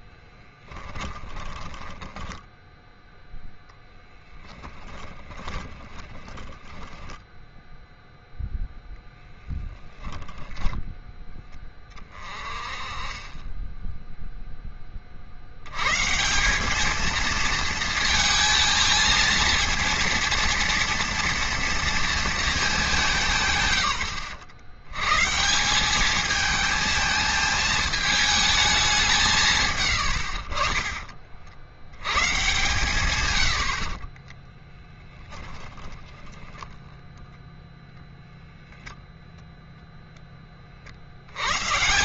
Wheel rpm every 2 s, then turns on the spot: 10, 0, 20, 10, 10, 20, 30, 20, 200, 230, 240, 210, 120, 220, 190, 40, 120, 10, 20, 0, 50.
0-2 4-12 30-32 34-38